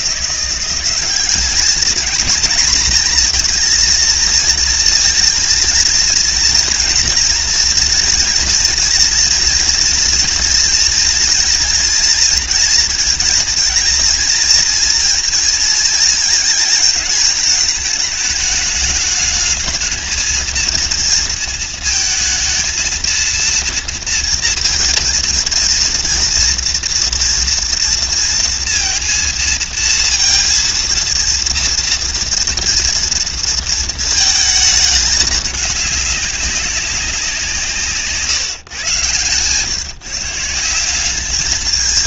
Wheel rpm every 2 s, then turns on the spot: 200, 220, 230, 230, 230, 230, 230, 230, 220, 210, 230, 230, 230, 230, 230, 230, 230, 210, 190, 110, 200.
none